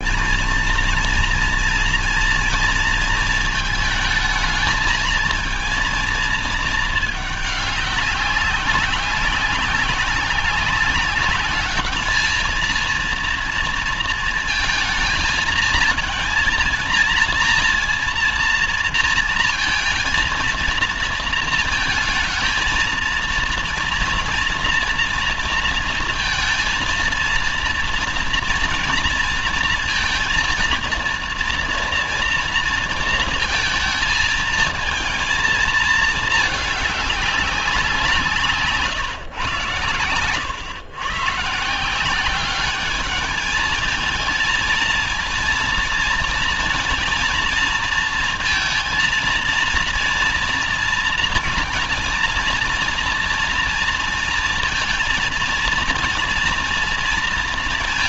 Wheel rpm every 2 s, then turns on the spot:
230, 230, 220, 220, 190, 190, 230, 230, 230, 230, 230, 230, 230, 230, 230, 230, 230, 220, 210, 160, 130, 200, 230, 230, 230, 230, 230, 230, 230.
38-40